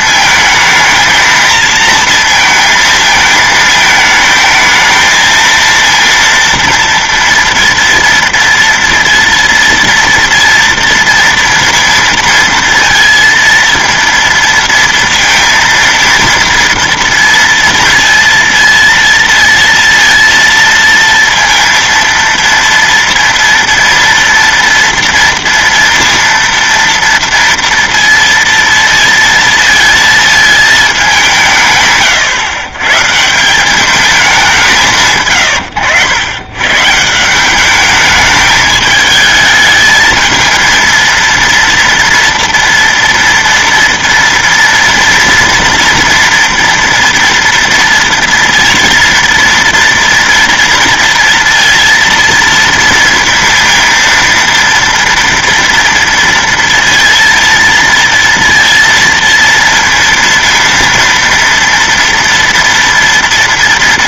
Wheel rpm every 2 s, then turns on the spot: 220, 230, 220, 230, 230, 230, 230, 230, 230, 230, 230, 230, 230, 230, 230, 220, 110, 180, 120, 210, 220, 230, 230, 230, 230, 230, 230, 230, 230, 230, 230, 230.
none